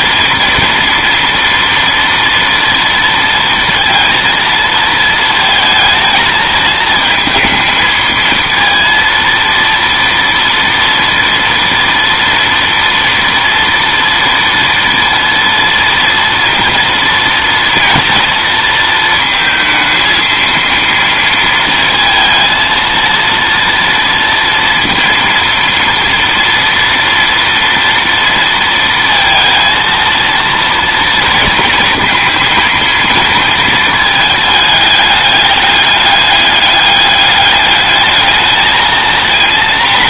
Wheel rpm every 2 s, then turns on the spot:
240, 230, 230, 220, 230, 230, 230, 230, 230, 230, 230, 230, 230, 240, 230, 230, 230, 210, 210, 220.
none